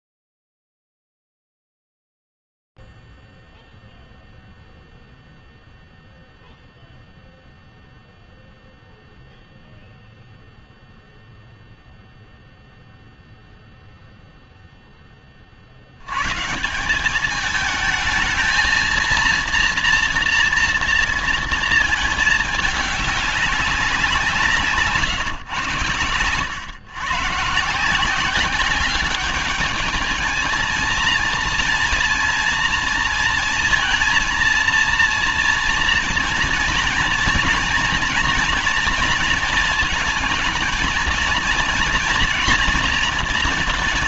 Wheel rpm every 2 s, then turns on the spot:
0, 0, 0, 0, 0, 0, 0, 40, 200, 230, 230, 200, 120, 140, 200, 230, 230, 230, 240, 230, 230, 230.
none